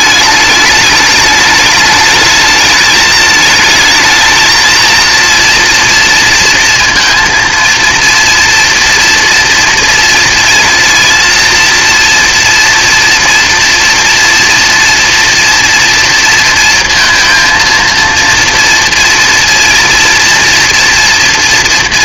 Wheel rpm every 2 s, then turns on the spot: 210, 210, 230, 230, 230, 230, 240, 230, 230, 230, 230.
none